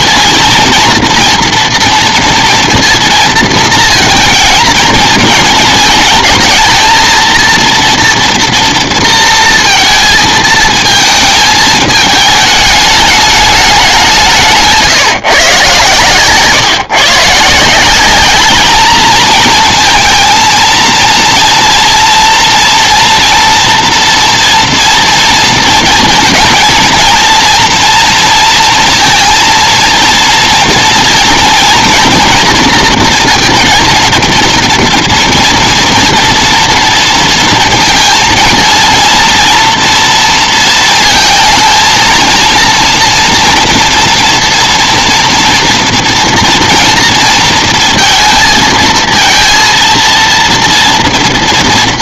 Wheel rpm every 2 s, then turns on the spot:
230, 230, 230, 220, 230, 230, 210, 170, 130, 190, 230, 230, 230, 230, 230, 230, 230, 230, 240, 230, 230, 230, 230, 230, 230, 230.
none